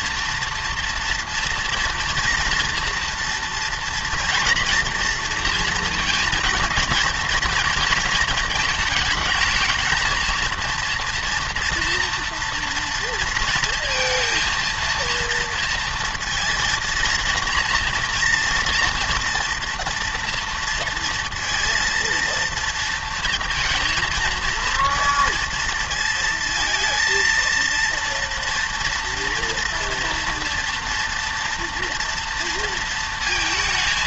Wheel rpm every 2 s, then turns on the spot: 240, 230, 230, 230, 220, 230, 230, 230, 230, 230, 230, 230, 230, 230, 230, 230, 230.
none